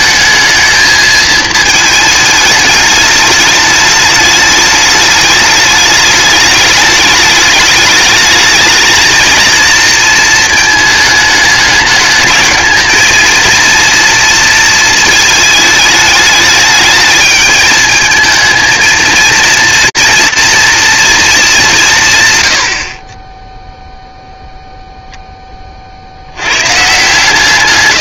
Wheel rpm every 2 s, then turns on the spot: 220, 210, 210, 210, 220, 220, 220, 230, 210, 230, 230, 60, 0, 160.
none